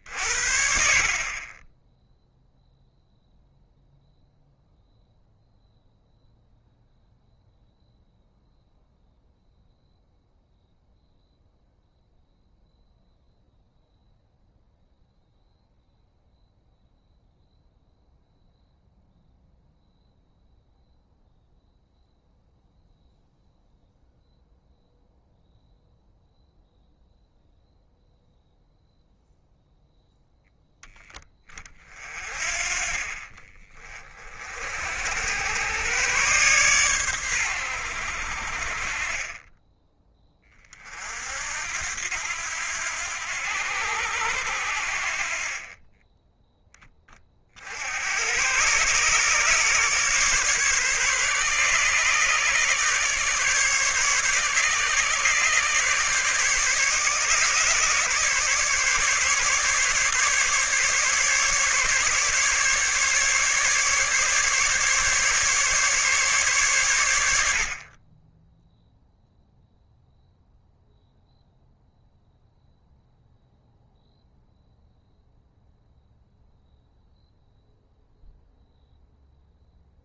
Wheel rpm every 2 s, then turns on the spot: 30, 0, 0, 0, 0, 0, 0, 0, 0, 0, 0, 0, 0, 0, 0, 10, 30, 80, 110, 30, 50, 90, 50, 20, 130, 140, 140, 150, 150, 150, 150, 150, 150, 110, 0, 0, 0, 0, 0, 0.
none